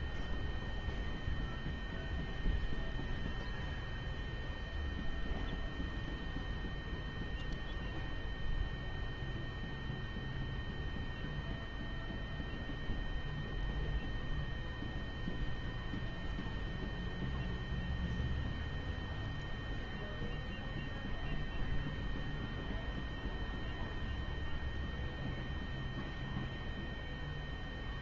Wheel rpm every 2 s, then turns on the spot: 0, 0, 0, 0, 0, 0, 0, 0, 0, 0, 0, 0, 0, 0.
none